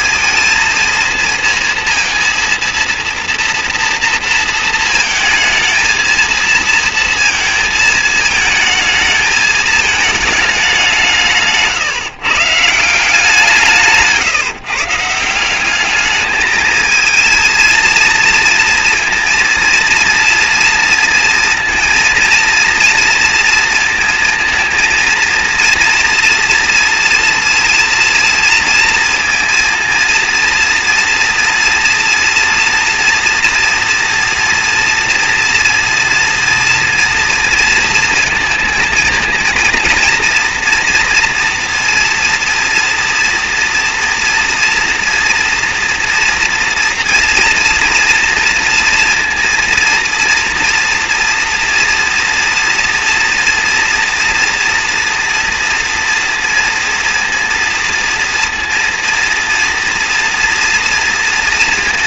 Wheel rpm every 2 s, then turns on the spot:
220, 230, 230, 230, 220, 180, 170, 160, 220, 230, 240, 230, 230, 230, 230, 240, 230, 230, 230, 230, 230, 230, 230, 230, 230, 230, 230, 230, 230, 230, 230.
none